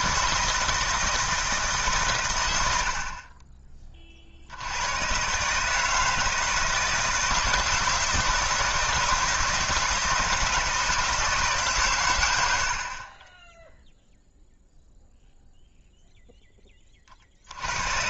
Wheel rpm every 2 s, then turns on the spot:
160, 100, 80, 160, 160, 160, 80, 0, 10.
none